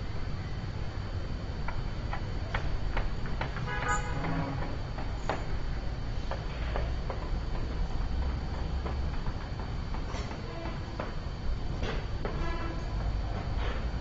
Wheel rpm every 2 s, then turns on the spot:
0, 0, 0, 0, 0, 0, 0.
none